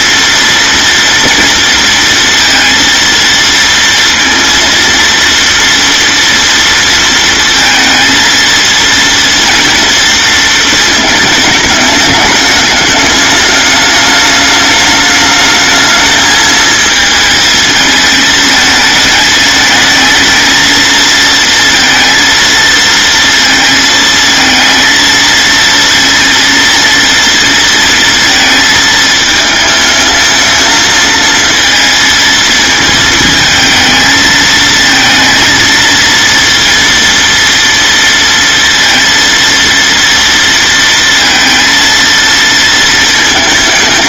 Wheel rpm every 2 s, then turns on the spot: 230, 230, 230, 230, 230, 230, 210, 210, 220, 220, 220, 230, 230, 230, 230, 220, 220, 220, 230, 230, 230, 230.
none